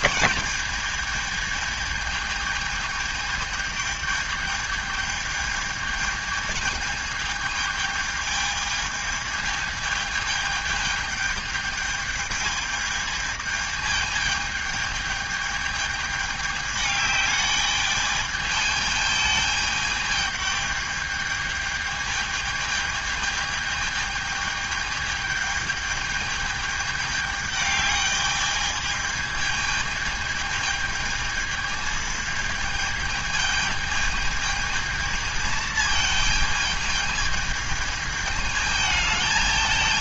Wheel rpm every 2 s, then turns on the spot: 210, 210, 210, 220, 220, 220, 210, 210, 210, 220, 210, 220, 220, 210, 210, 220, 220, 220, 220, 210.
none